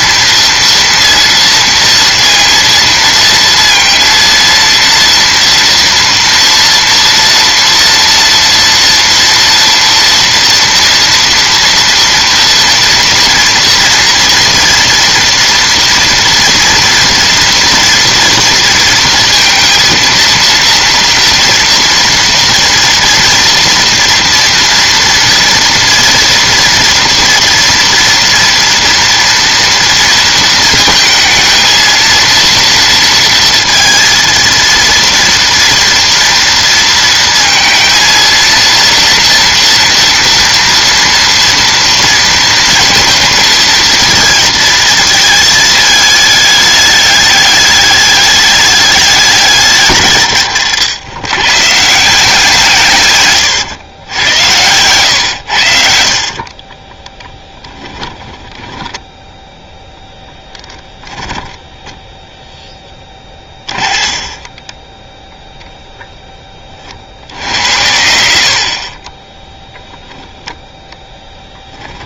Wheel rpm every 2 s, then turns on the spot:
240, 230, 230, 230, 230, 230, 230, 240, 240, 230, 240, 240, 230, 230, 230, 220, 230, 230, 230, 230, 230, 220, 220, 210, 210, 120, 160, 100, 30, 10, 10, 0, 30, 30, 70, 10.
56-62 64-66 68-70